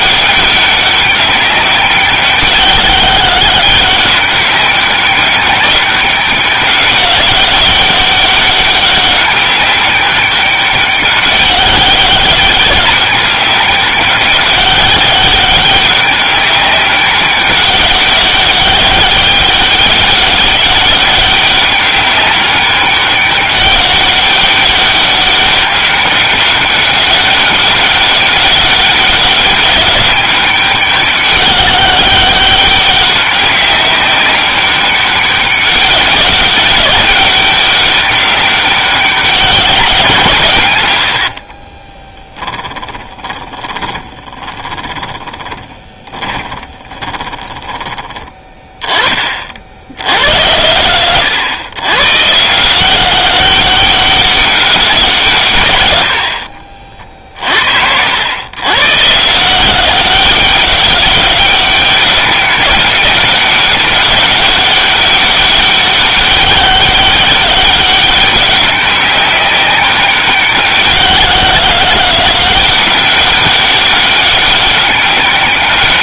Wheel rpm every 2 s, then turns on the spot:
200, 190, 190, 190, 200, 200, 200, 200, 190, 190, 190, 200, 200, 200, 200, 200, 200, 200, 200, 200, 120, 10, 20, 20, 20, 100, 170, 190, 50, 120, 200, 200, 200, 200, 190, 190, 190, 200.
40-48